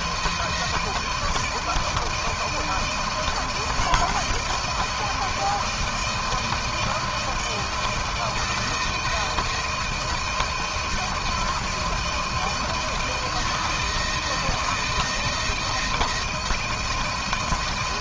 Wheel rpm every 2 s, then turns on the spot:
170, 160, 160, 170, 160, 160, 160, 160, 160.
none